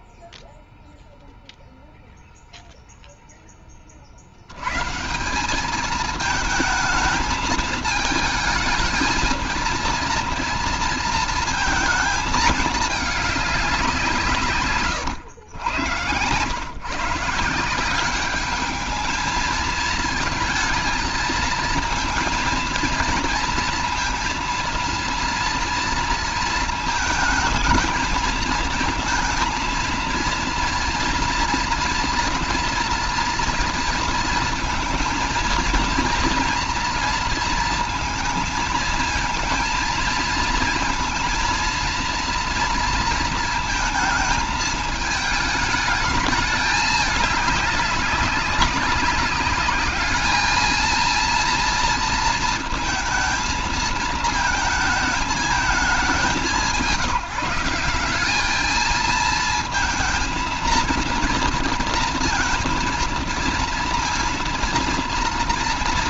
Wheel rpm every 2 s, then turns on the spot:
0, 0, 90, 220, 220, 230, 220, 150, 130, 210, 220, 230, 230, 230, 220, 230, 240, 230, 230, 230, 220, 230, 220, 210, 200, 220, 230, 220, 180, 210, 230, 230, 230.
none